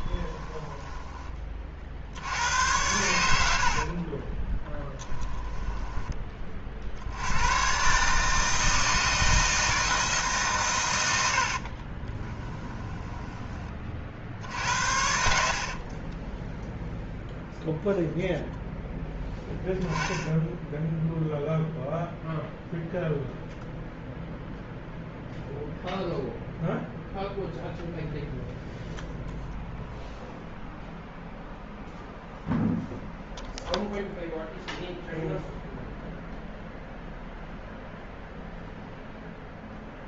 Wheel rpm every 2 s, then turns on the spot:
10, 90, 10, 40, 160, 110, 10, 60, 0, 0, 10, 0, 0, 0, 0, 0, 0, 0, 0, 0.
0-2 4-6 12-14